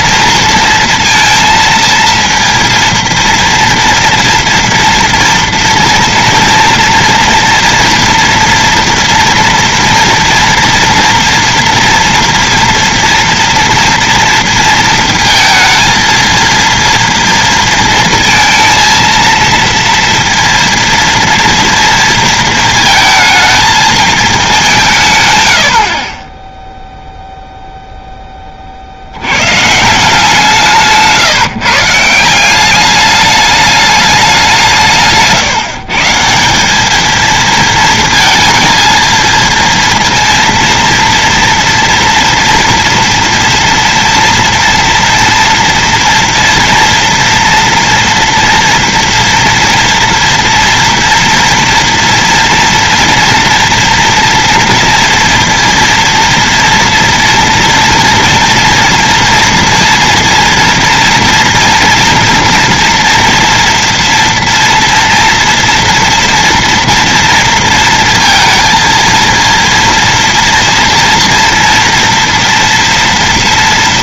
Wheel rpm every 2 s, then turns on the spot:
230, 230, 230, 230, 240, 230, 230, 230, 230, 230, 230, 220, 160, 0, 60, 170, 190, 180, 200, 230, 230, 230, 230, 230, 230, 230, 230, 230, 230, 230, 230, 240, 230, 230, 230, 230, 230.
none